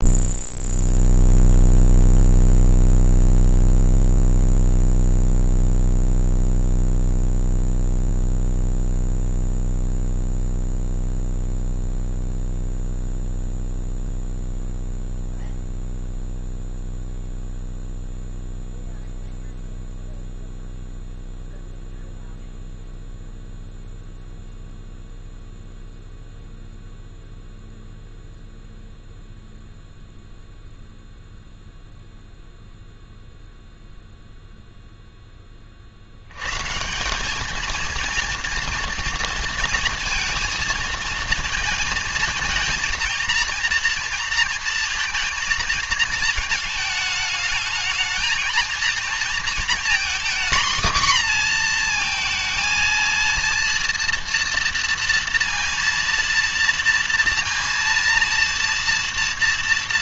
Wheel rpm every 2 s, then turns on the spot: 0, 0, 0, 0, 0, 0, 0, 0, 0, 0, 0, 0, 0, 0, 0, 0, 0, 0, 150, 230, 230, 220, 230, 220, 230, 250, 230, 230, 230, 230.
none